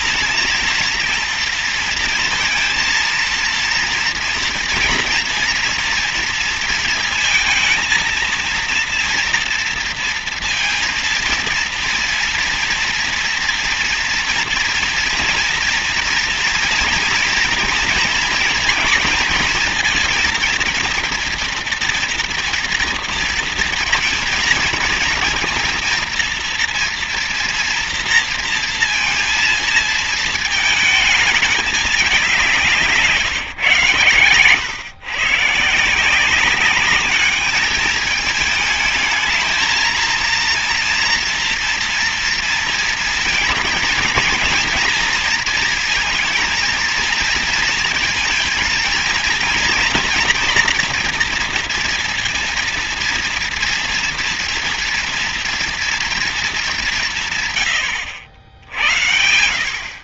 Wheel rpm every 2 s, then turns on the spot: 230, 230, 230, 230, 230, 230, 230, 230, 230, 240, 230, 230, 230, 230, 230, 230, 190, 110, 190, 220, 230, 230, 230, 230, 230, 240, 230, 230, 210, 80.
none